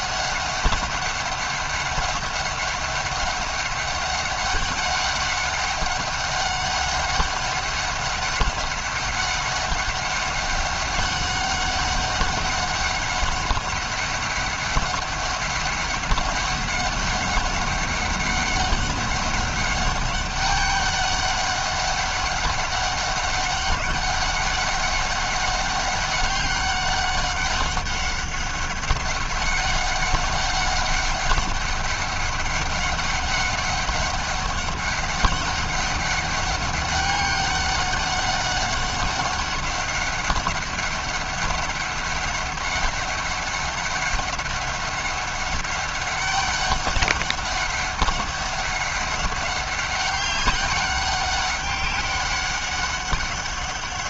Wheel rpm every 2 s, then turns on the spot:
190, 190, 200, 200, 200, 190, 190, 200, 200, 200, 200, 200, 200, 200, 190, 190, 200, 200, 200, 200, 200, 190, 200, 200, 200, 190, 200.
none